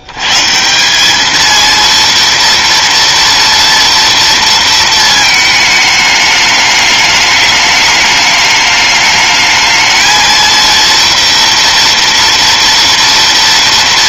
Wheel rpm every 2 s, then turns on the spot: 190, 230, 220, 210, 210, 230, 230.
none